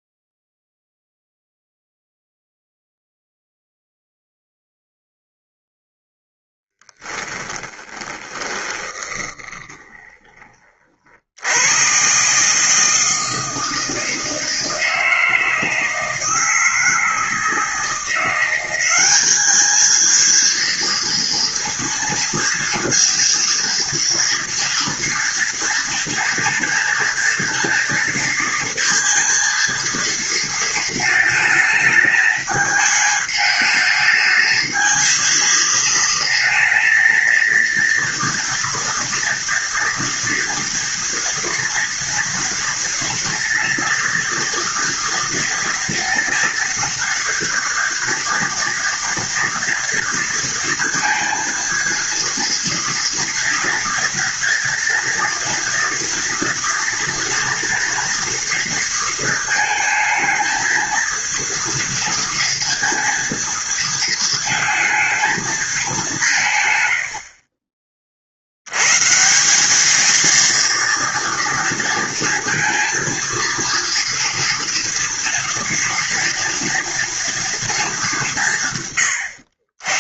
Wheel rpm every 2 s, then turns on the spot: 0, 0, 0, 10, 20, 60, 160, 160, 160, 200, 230, 230, 230, 230, 230, 220, 220, 230, 230, 230, 240, 230, 230, 230, 230, 230, 230, 230, 230, 230, 230, 230, 230, 90, 140, 230, 230, 230, 230, 110.
6-10